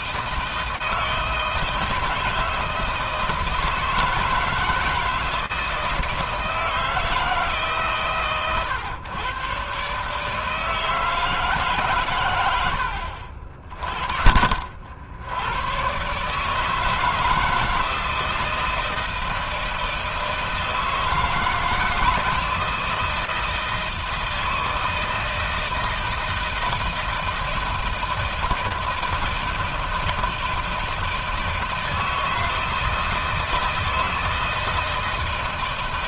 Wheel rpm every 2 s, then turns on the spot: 160, 160, 160, 160, 120, 160, 80, 50, 150, 160, 160, 160, 160, 160, 160, 160, 160, 160.
none